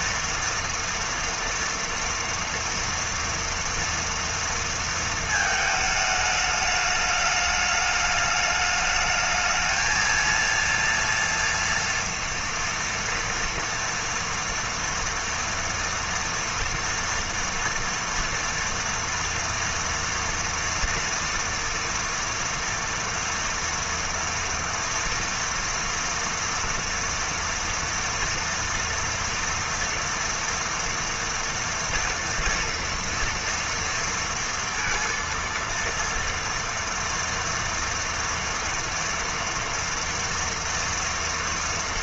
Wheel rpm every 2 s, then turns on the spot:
230, 230, 220, 210, 210, 230, 240, 230, 230, 230, 230, 230, 230, 230, 230, 230, 230, 230, 230, 230, 230.
none